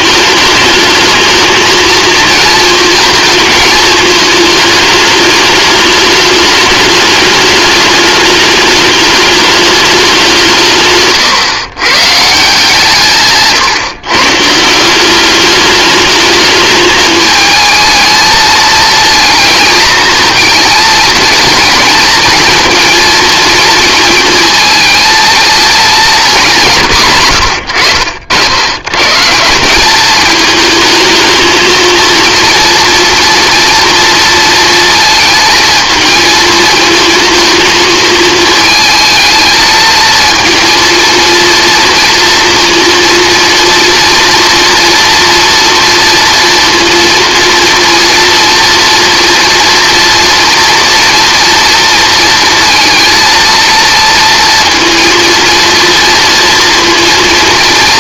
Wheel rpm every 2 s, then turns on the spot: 210, 230, 210, 220, 210, 150, 170, 170, 220, 220, 220, 220, 230, 160, 100, 220, 230, 230, 220, 220, 230, 230, 240, 230, 230, 230, 230, 230, 230.
26-28